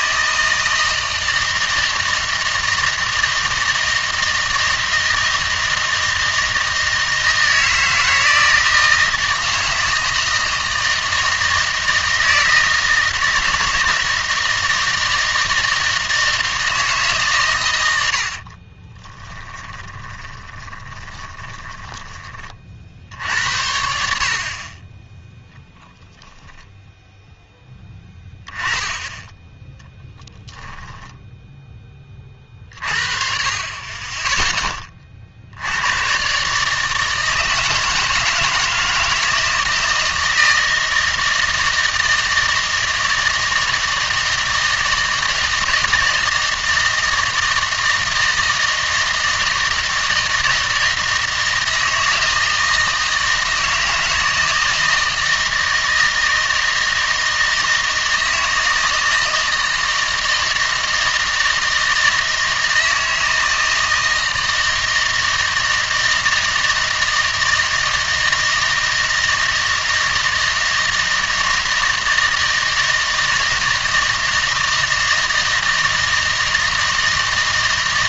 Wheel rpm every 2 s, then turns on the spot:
160, 160, 160, 160, 160, 160, 160, 160, 160, 40, 20, 50, 30, 0, 20, 10, 40, 10, 150, 160, 160, 160, 160, 160, 160, 160, 160, 160, 160, 160, 160, 160, 160, 160, 160, 160, 160, 160, 160.
18-22 30-32